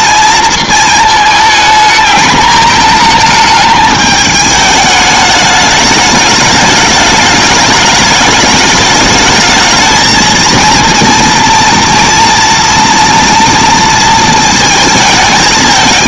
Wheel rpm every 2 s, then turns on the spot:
230, 210, 210, 210, 210, 230, 230, 230.
none